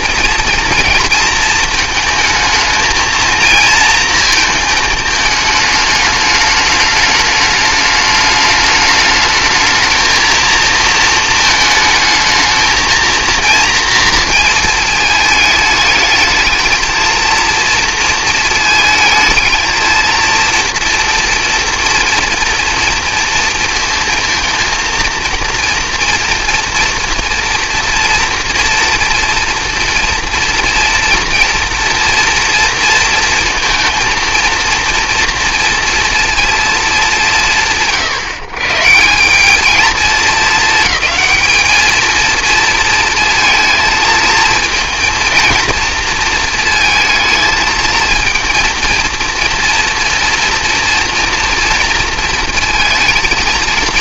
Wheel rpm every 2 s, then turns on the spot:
230, 220, 220, 210, 210, 230, 230, 220, 220, 220, 230, 230, 230, 230, 230, 230, 230, 230, 210, 150, 210, 230, 230, 230, 230, 240, 230.
none